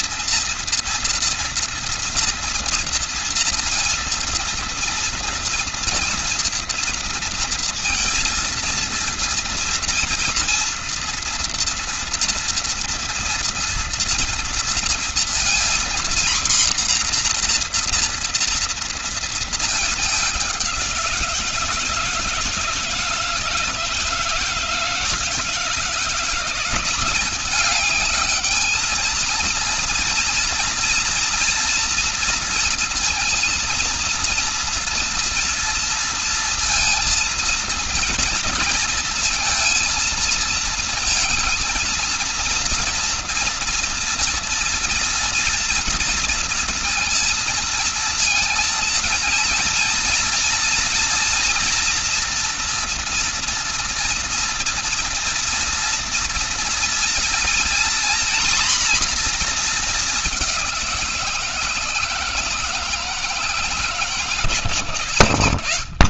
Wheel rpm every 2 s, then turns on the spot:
230, 240, 230, 230, 230, 230, 230, 230, 250, 230, 190, 160, 160, 180, 220, 230, 230, 230, 230, 230, 220, 230, 240, 230, 230, 230, 230, 230, 230, 240, 190, 160, 140.
none